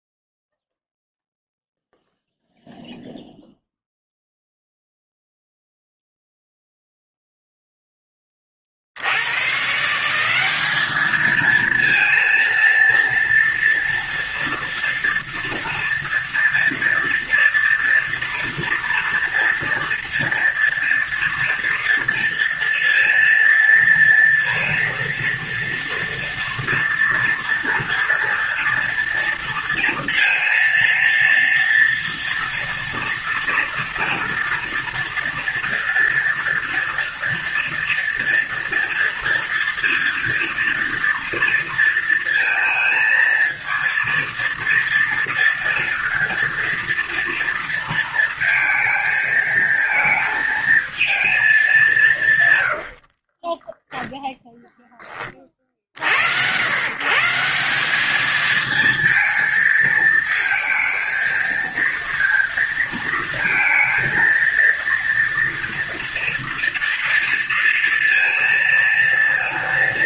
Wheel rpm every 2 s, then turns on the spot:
0, 0, 0, 0, 20, 190, 230, 230, 230, 240, 230, 230, 230, 230, 240, 230, 230, 230, 230, 230, 230, 220, 230, 230, 230, 220, 130, 0, 100, 220, 220, 230, 230, 230, 230.
none